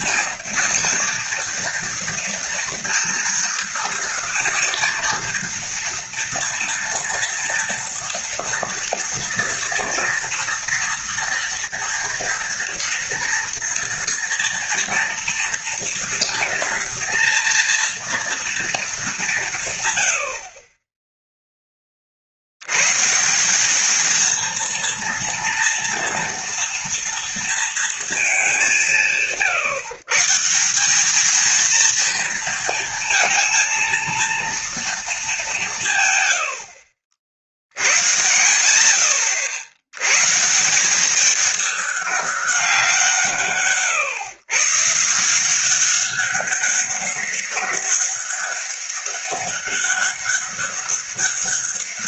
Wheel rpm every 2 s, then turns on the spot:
230, 230, 230, 230, 230, 230, 230, 240, 240, 210, 20, 110, 230, 230, 180, 200, 230, 230, 70, 60, 190, 180, 150, 200, 200, 200.
none